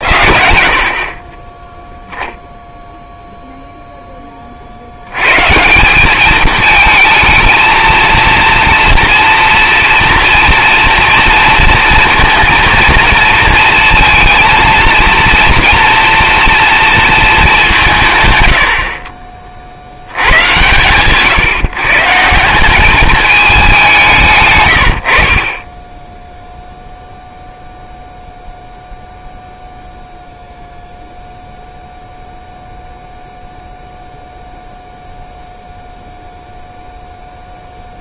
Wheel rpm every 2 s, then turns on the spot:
50, 0, 40, 220, 230, 230, 230, 230, 230, 70, 110, 190, 120, 0, 0, 0, 0, 0, 0.
none